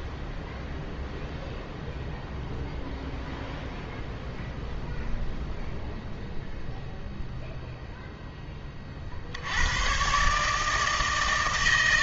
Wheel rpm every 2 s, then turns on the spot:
0, 0, 0, 0, 20, 150.
none